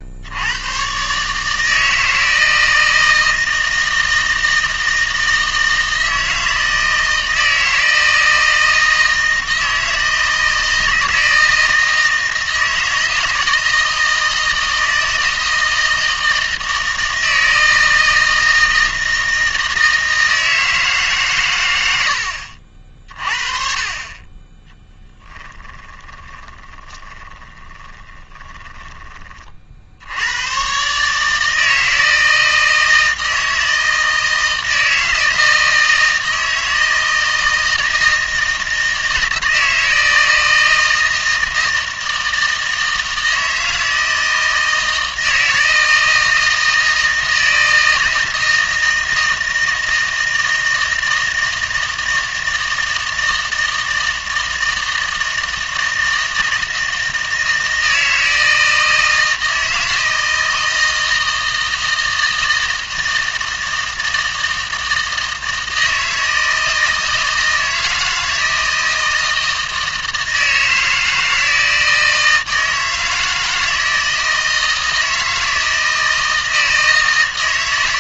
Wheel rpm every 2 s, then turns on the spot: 110, 160, 160, 160, 160, 160, 160, 160, 160, 160, 160, 50, 20, 20, 20, 130, 160, 160, 160, 160, 160, 160, 160, 160, 160, 160, 160, 160, 160, 160, 160, 160, 160, 160, 160, 160, 160, 160, 160.
24-30